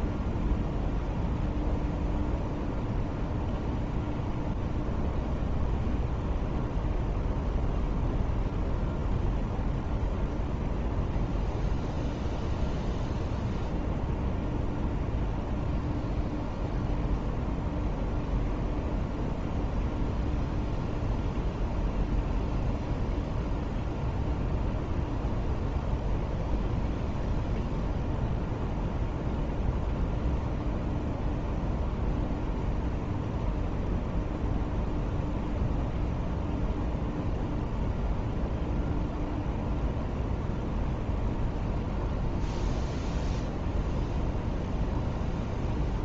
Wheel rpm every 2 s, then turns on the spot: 0, 0, 0, 0, 0, 0, 0, 0, 0, 0, 0, 0, 0, 0, 0, 0, 0, 0, 0, 0, 0, 0, 0.
none